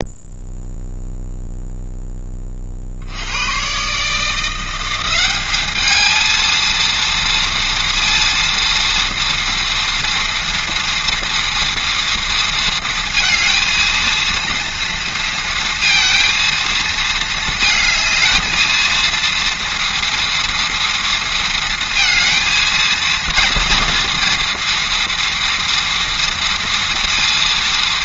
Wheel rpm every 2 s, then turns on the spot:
0, 70, 180, 230, 230, 230, 230, 230, 220, 220, 230, 230, 230, 230.
none